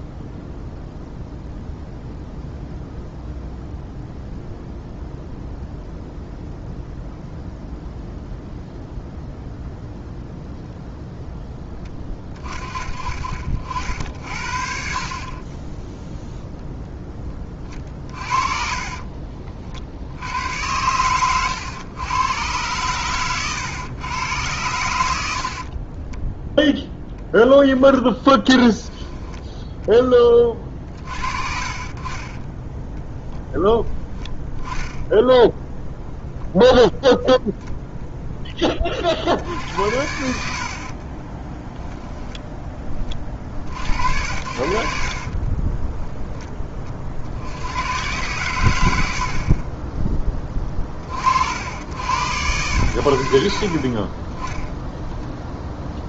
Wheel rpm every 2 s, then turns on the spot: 0, 0, 0, 0, 0, 0, 30, 70, 0, 40, 90, 120, 100, 0, 10, 40, 20, 10, 0, 20, 60, 10, 70, 30, 90, 20, 90, 10.
18-20 22-24 40-42 44-46